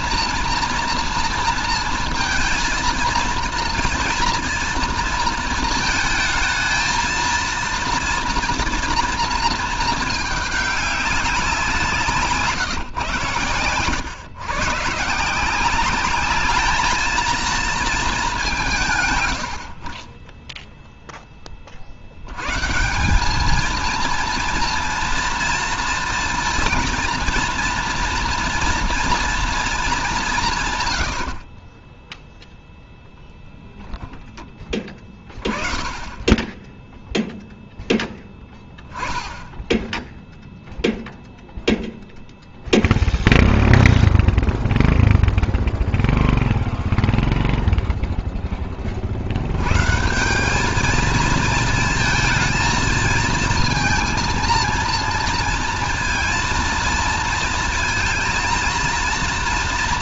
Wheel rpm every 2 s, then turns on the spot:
230, 230, 230, 220, 230, 200, 120, 130, 210, 160, 0, 170, 230, 230, 240, 140, 10, 20, 10, 10, 0, 0, 0, 0, 30, 210, 220, 230, 230, 230.
32-34